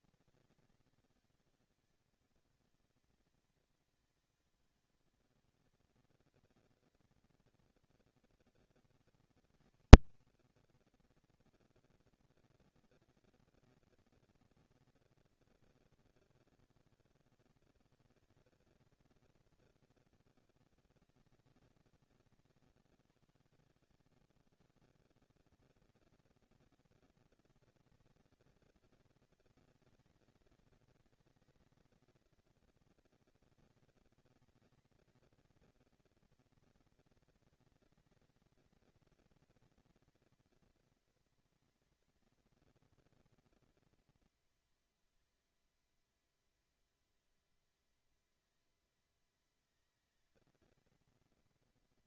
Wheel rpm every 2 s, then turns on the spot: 230, 220, 210, 220, 220, 260, 230, 230, 220, 220, 210, 160, 130, 220, 230, 220, 230, 230, 230, 220, 230, 240, 230, 230, 230, 220.
none